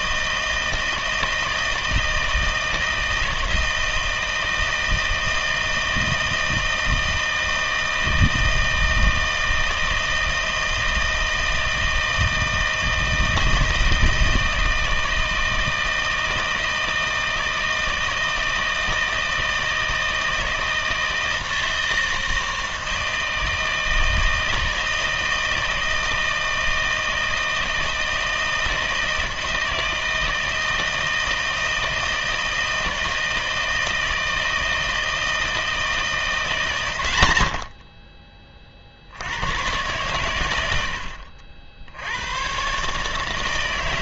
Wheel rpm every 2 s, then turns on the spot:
160, 160, 160, 160, 160, 160, 160, 160, 160, 160, 160, 160, 160, 160, 160, 160, 160, 160, 140, 40, 80, 140.
none